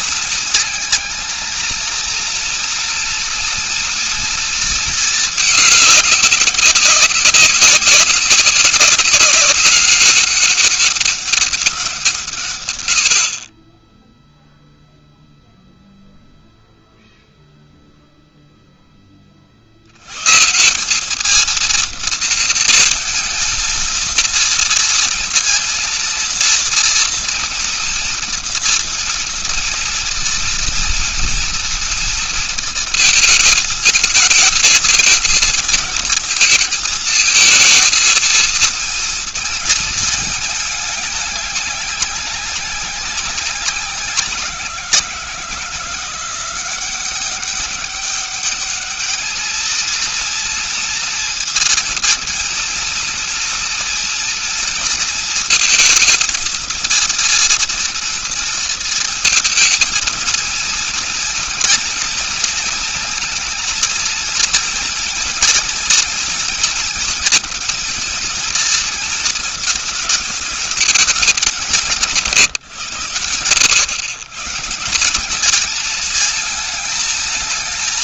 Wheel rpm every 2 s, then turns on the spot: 230, 230, 230, 200, 200, 200, 130, 0, 0, 0, 140, 230, 230, 230, 230, 230, 230, 220, 220, 230, 210, 200, 170, 180, 200, 230, 230, 230, 230, 230, 230, 220, 230, 230, 230, 220, 130, 160, 220.
none